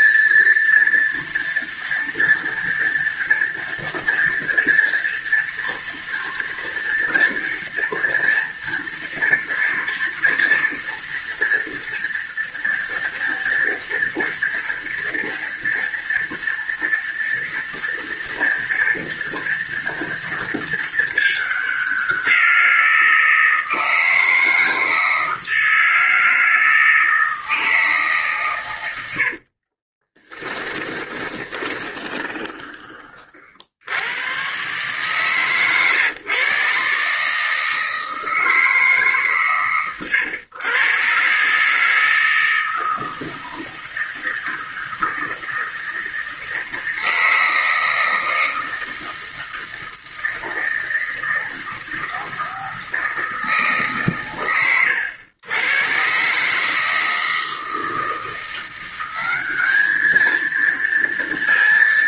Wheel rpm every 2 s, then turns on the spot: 230, 230, 230, 230, 230, 240, 240, 230, 230, 240, 210, 170, 160, 160, 90, 20, 30, 130, 140, 150, 130, 160, 160, 160, 160, 160, 160, 100, 160, 190, 230.
28-32